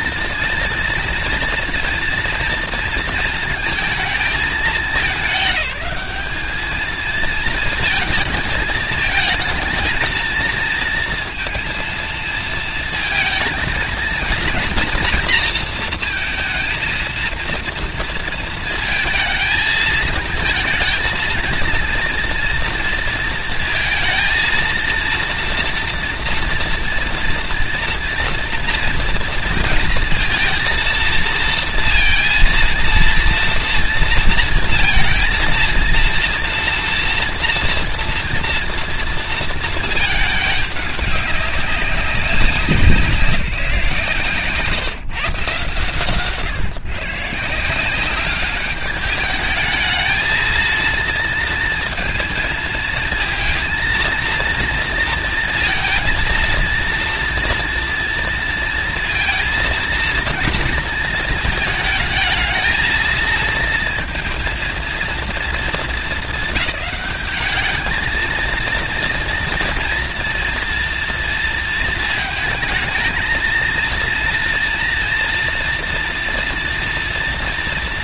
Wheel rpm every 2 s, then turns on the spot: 230, 230, 210, 230, 220, 230, 230, 230, 230, 230, 230, 230, 230, 240, 230, 230, 230, 230, 240, 230, 200, 180, 160, 150, 210, 230, 230, 230, 230, 230, 220, 220, 220, 200, 230, 230, 220, 230, 230.
none